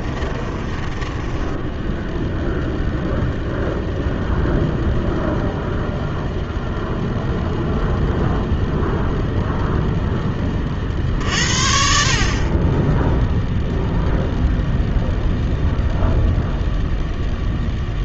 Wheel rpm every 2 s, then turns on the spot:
20, 0, 0, 0, 0, 40, 30, 0, 0.
0-2